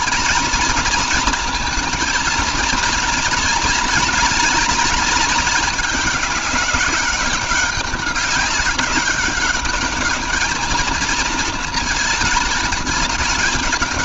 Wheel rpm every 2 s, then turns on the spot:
230, 240, 220, 200, 200, 230, 220.
none